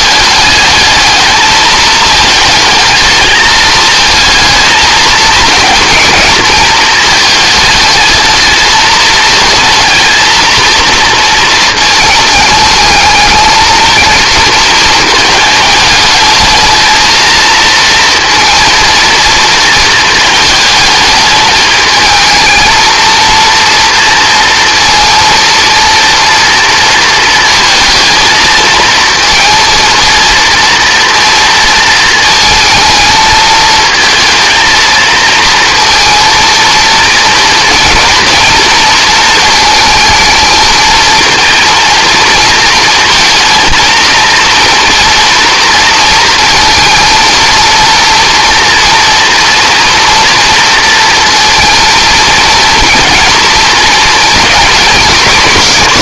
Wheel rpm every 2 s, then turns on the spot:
210, 220, 220, 220, 220, 230, 220, 220, 220, 230, 220, 230, 230, 230, 230, 230, 220, 230, 230, 230, 220, 230, 230, 230, 230, 230, 230, 230.
none